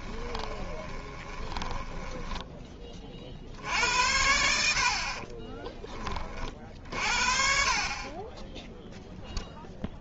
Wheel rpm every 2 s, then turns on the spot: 20, 20, 60, 50, 0.
0-2